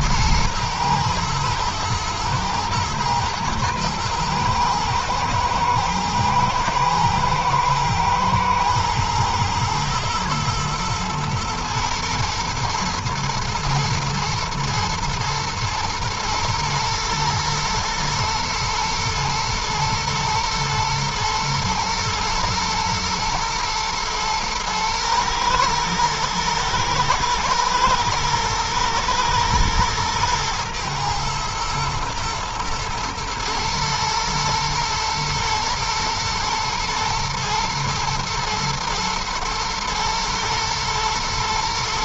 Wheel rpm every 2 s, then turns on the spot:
110, 110, 110, 110, 110, 110, 110, 110, 110, 110, 120, 110, 110, 110, 110, 120, 120, 110, 110, 110, 110.
none